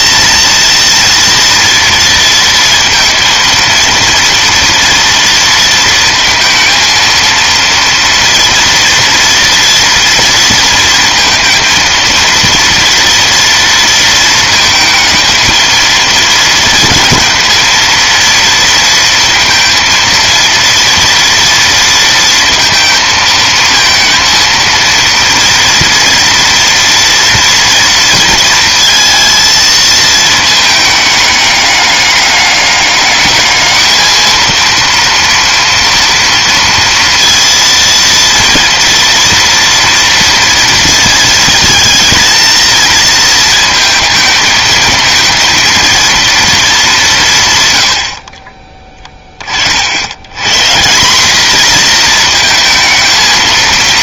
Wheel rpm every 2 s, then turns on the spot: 230, 230, 230, 220, 230, 230, 230, 220, 230, 230, 230, 230, 230, 230, 230, 220, 200, 230, 230, 230, 230, 220, 220, 230, 30, 160, 230.
none